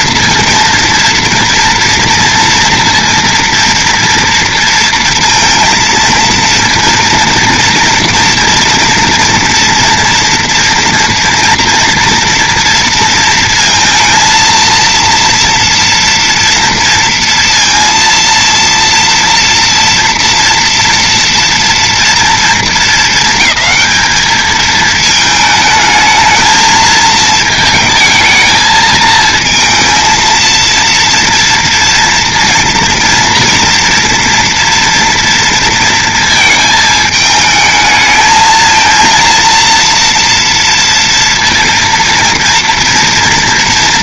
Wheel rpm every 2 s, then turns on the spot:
230, 230, 230, 230, 230, 230, 230, 230, 230, 230, 230, 230, 220, 220, 220, 230, 240, 230, 220, 220, 230, 230.
none